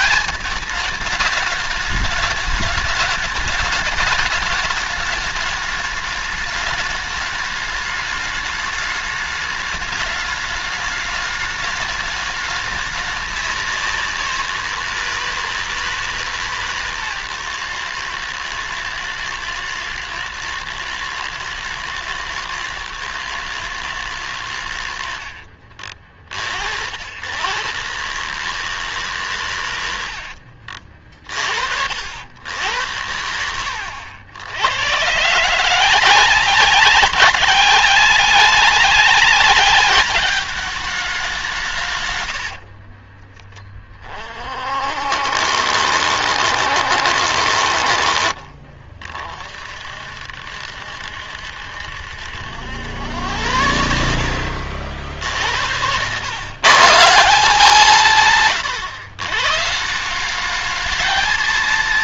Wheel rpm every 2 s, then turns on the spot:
210, 210, 210, 210, 210, 210, 210, 170, 140, 110, 110, 110, 80, 80, 150, 60, 100, 110, 190, 190, 210, 40, 50, 70, 40, 70, 90, 70, 150, 110, 210.
42-44